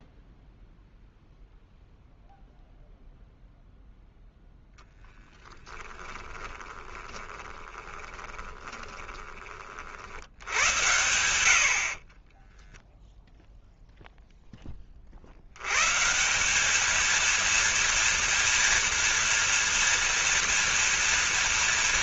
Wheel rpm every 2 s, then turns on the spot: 0, 0, 10, 20, 20, 90, 10, 10, 200, 230, 230.
6-10